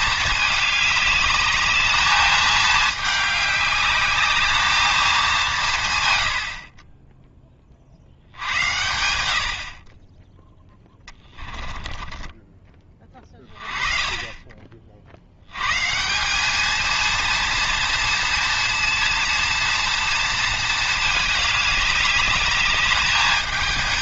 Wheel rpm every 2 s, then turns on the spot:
210, 210, 220, 70, 80, 10, 20, 30, 220, 230, 220, 210.
12-14